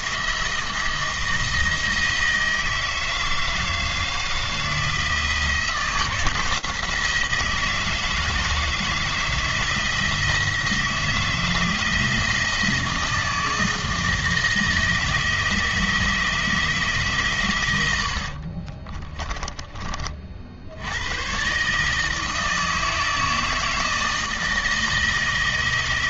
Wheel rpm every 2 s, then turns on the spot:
160, 160, 160, 170, 160, 160, 160, 160, 160, 30, 90, 160, 160.
18-20